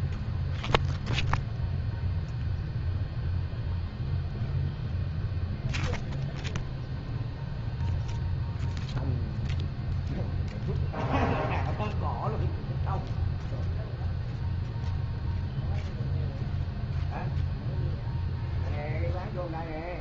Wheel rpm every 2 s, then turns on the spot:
0, 0, 0, 0, 0, 0, 0, 0, 0, 0.
none